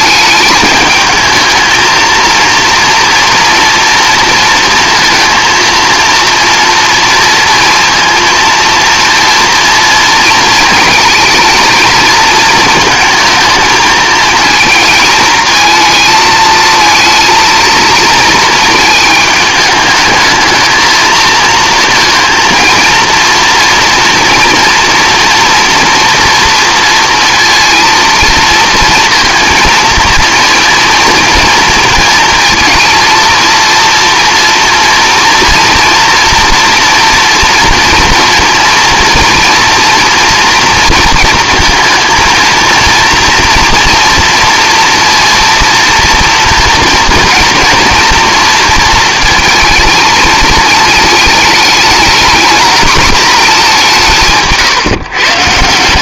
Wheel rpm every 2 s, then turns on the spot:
220, 230, 230, 230, 230, 230, 230, 220, 220, 220, 220, 230, 230, 230, 230, 230, 230, 230, 240, 230, 230, 230, 230, 230, 230, 220, 230, 130.
none